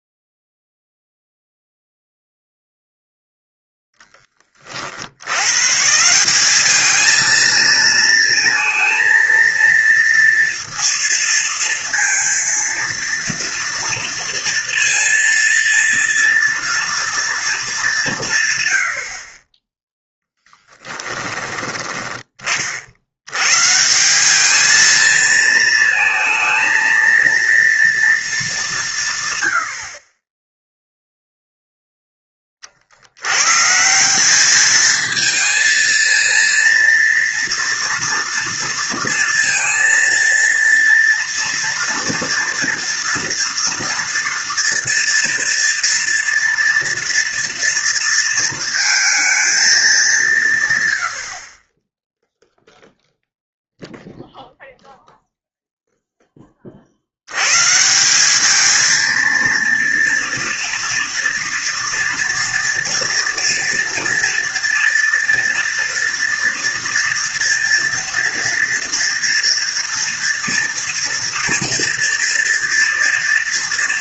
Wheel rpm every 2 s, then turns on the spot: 0, 0, 40, 200, 230, 230, 230, 230, 230, 90, 10, 50, 220, 220, 180, 0, 40, 220, 230, 230, 230, 230, 230, 230, 230, 120, 0, 0, 40, 220, 240, 240, 240, 230, 230, 230, 230.
none